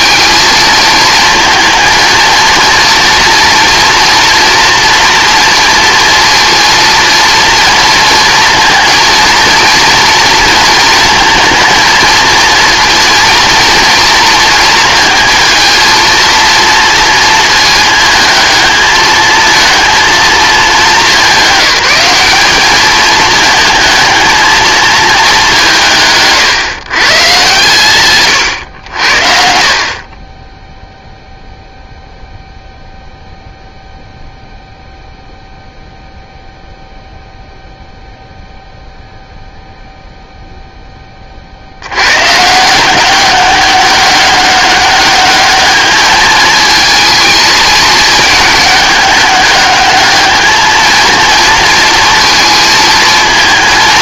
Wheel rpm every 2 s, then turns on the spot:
220, 230, 240, 230, 230, 230, 230, 230, 230, 220, 220, 210, 220, 140, 110, 10, 0, 0, 0, 0, 0, 160, 200, 220, 210, 220, 230.
none